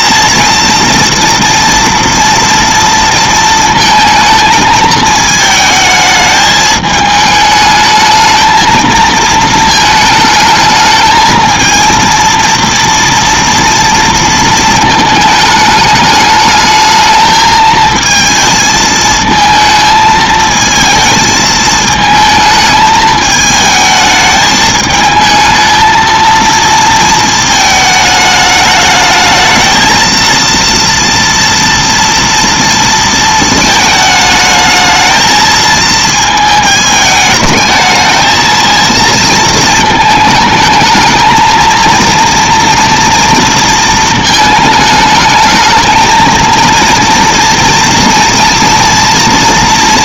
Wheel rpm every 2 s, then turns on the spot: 230, 230, 220, 210, 220, 220, 230, 230, 210, 220, 220, 220, 220, 230, 210, 230, 230, 220, 220, 230, 220, 230, 220, 230, 240.
none